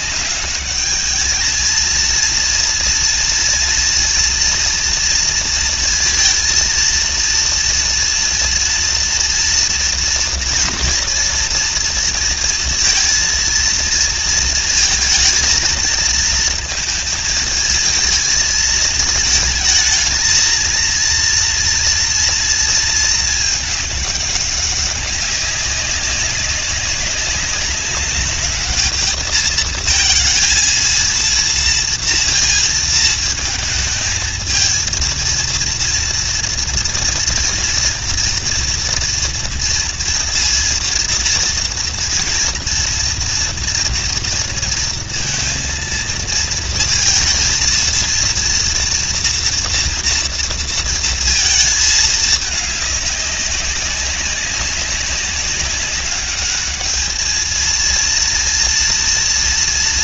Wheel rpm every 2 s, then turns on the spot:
200, 230, 230, 230, 230, 230, 230, 230, 230, 220, 230, 230, 200, 190, 210, 220, 230, 230, 230, 230, 230, 230, 230, 230, 230, 230, 210, 190, 210, 230.
none